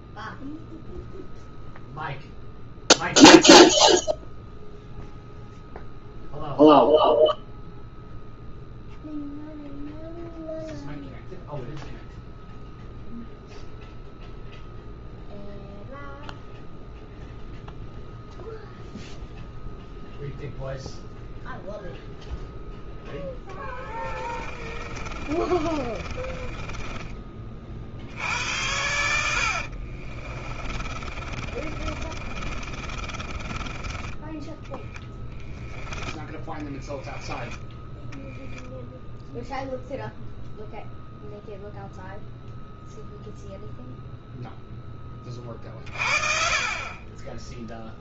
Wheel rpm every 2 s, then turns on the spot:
0, 0, 0, 0, 0, 0, 0, 0, 0, 0, 0, 0, 30, 20, 80, 30, 30, 10, 10, 0, 0, 0, 10, 20.
24-36